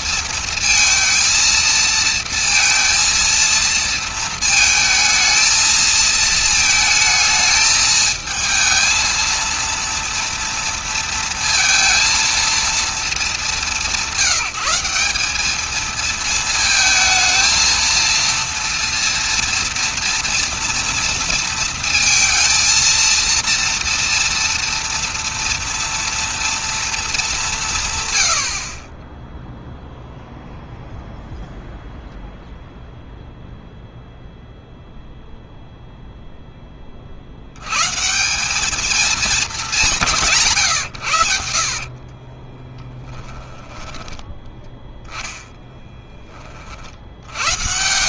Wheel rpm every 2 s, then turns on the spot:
230, 230, 220, 220, 220, 230, 230, 180, 220, 230, 230, 230, 240, 230, 60, 0, 0, 0, 20, 200, 120, 20, 10, 40.
42-44